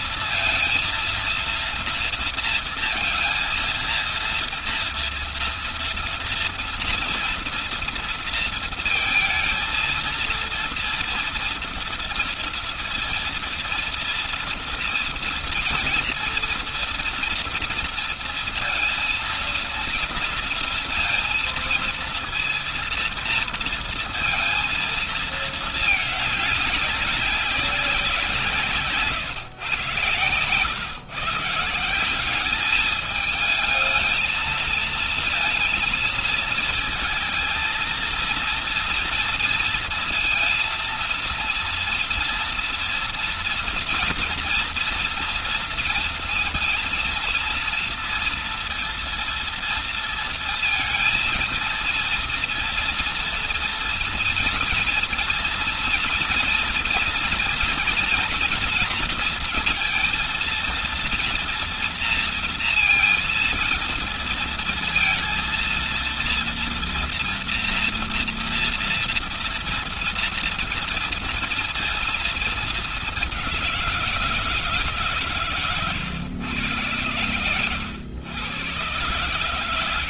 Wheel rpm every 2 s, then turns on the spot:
230, 230, 230, 230, 230, 230, 230, 230, 230, 230, 230, 230, 230, 210, 170, 110, 200, 220, 220, 230, 230, 240, 230, 230, 230, 230, 230, 230, 230, 230, 230, 230, 230, 230, 230, 230, 220, 170, 110, 120.
none